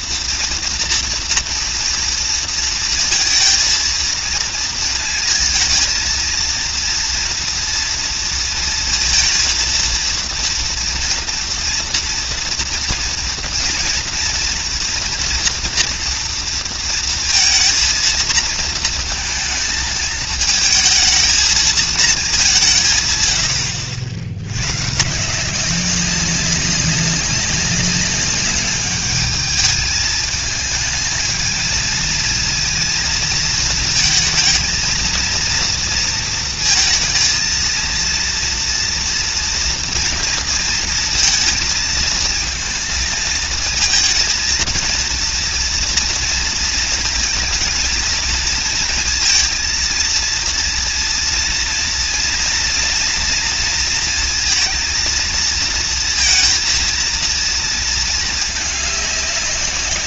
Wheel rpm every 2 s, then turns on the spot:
230, 230, 230, 230, 230, 230, 230, 230, 230, 230, 220, 160, 130, 200, 210, 220, 230, 230, 230, 230, 230, 220, 230, 230, 230, 230, 230, 230, 230, 200.
none